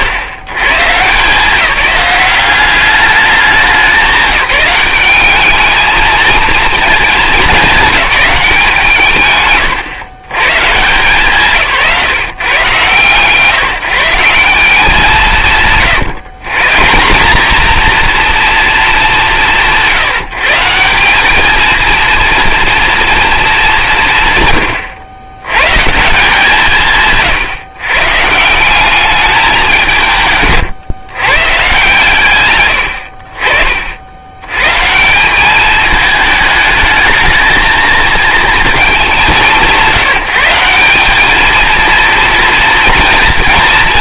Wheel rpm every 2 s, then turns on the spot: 110, 190, 190, 220, 160, 170, 130, 170, 130, 200, 160, 230, 120, 160, 180, 130, 50, 130, 210, 220, 180, 230.
none